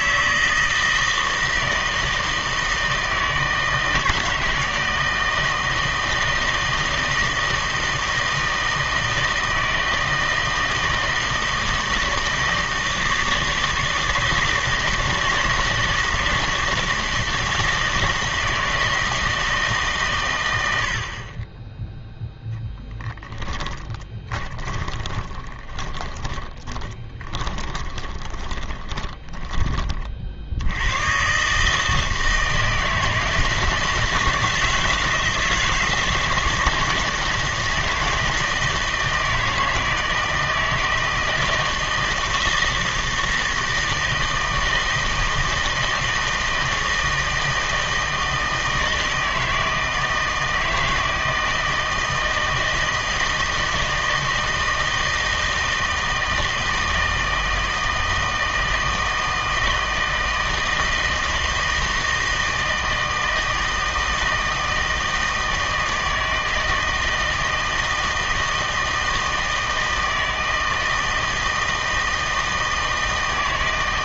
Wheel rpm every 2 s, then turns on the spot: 160, 160, 160, 160, 160, 160, 160, 160, 160, 160, 70, 10, 20, 20, 10, 90, 160, 160, 160, 160, 160, 160, 160, 160, 160, 160, 160, 160, 160, 160, 160, 160, 160, 160, 160, 160, 160.
22-30